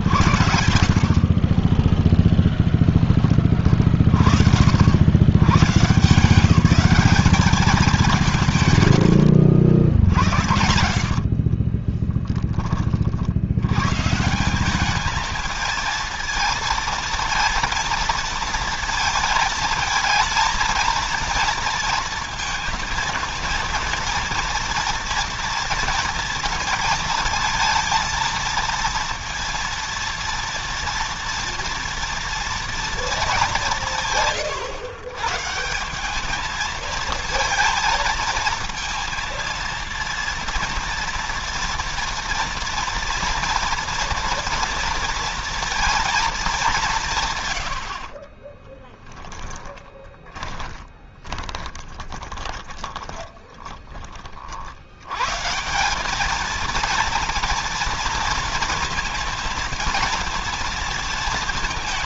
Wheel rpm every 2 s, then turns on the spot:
50, 10, 60, 180, 140, 80, 20, 190, 230, 230, 220, 230, 230, 230, 230, 230, 230, 120, 220, 230, 230, 230, 230, 190, 10, 40, 30, 70, 220, 230, 230.
10-12 48-54